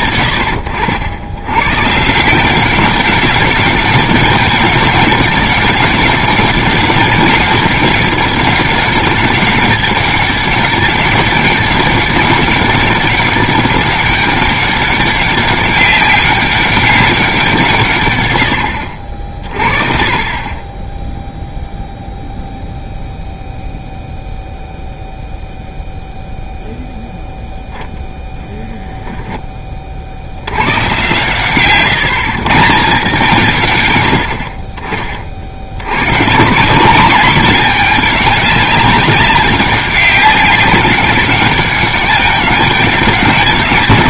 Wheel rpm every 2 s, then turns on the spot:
90, 190, 200, 200, 200, 190, 200, 200, 190, 60, 10, 0, 0, 0, 0, 70, 160, 30, 190, 200, 190, 200.
none